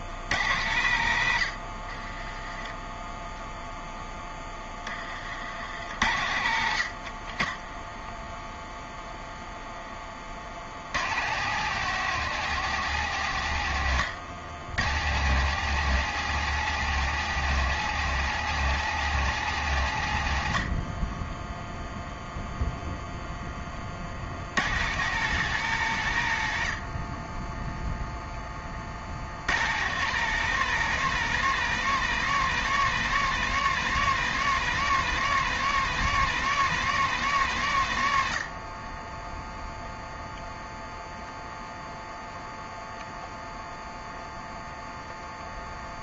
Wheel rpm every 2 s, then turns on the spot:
90, 10, 40, 50, 0, 110, 150, 130, 170, 160, 20, 0, 130, 40, 40, 180, 180, 190, 180, 50, 0, 0, 0.
none